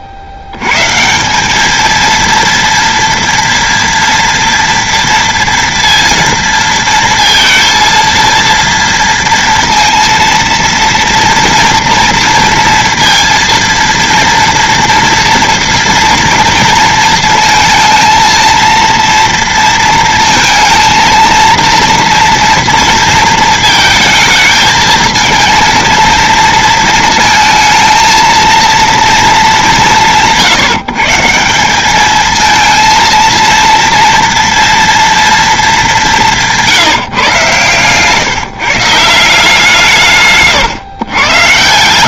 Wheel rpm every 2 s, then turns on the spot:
70, 230, 230, 230, 230, 230, 230, 230, 230, 230, 230, 230, 220, 230, 230, 170, 220, 230, 170, 140, 140.
none